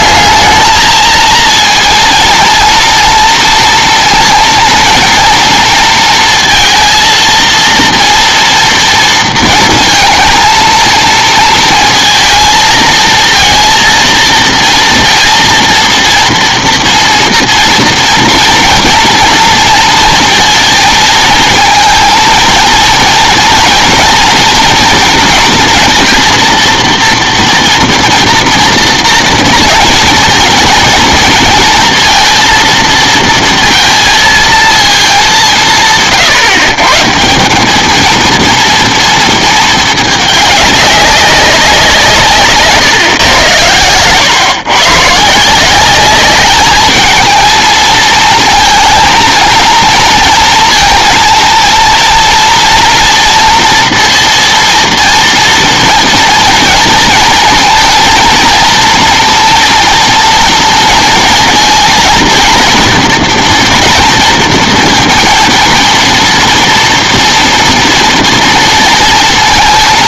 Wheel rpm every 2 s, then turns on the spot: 220, 230, 230, 230, 230, 230, 220, 230, 230, 230, 230, 230, 230, 230, 230, 220, 230, 220, 140, 230, 200, 140, 120, 210, 220, 230, 230, 230, 230, 230, 230, 230, 230, 230, 230.
none